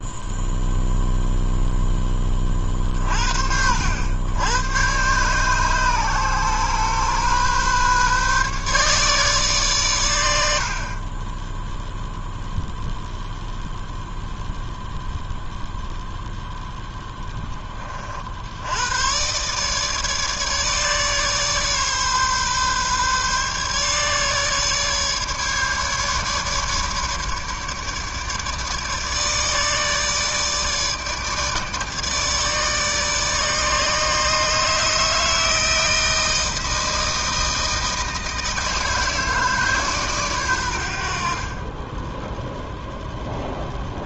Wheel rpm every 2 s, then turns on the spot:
0, 40, 120, 130, 150, 30, 0, 0, 10, 100, 150, 140, 150, 150, 150, 150, 150, 160, 160, 160, 70, 0.
none